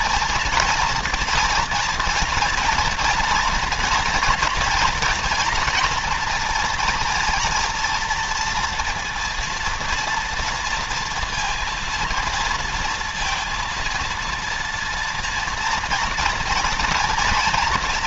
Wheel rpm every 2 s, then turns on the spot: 230, 230, 240, 240, 230, 230, 230, 230, 230.
none